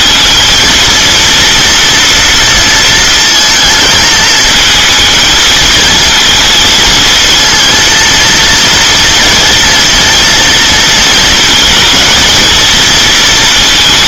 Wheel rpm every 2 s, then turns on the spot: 230, 230, 220, 220, 230, 230, 230.
none